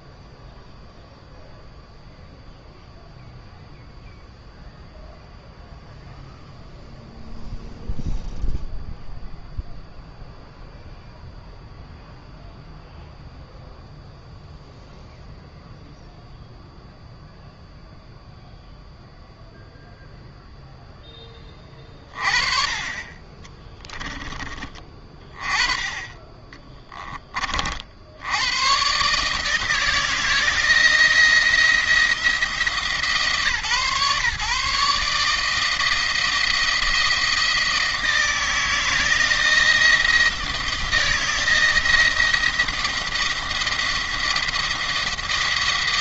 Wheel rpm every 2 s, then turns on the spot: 0, 0, 0, 0, 0, 0, 0, 0, 0, 0, 0, 30, 20, 20, 120, 170, 160, 150, 170, 160, 160, 170, 170.
26-28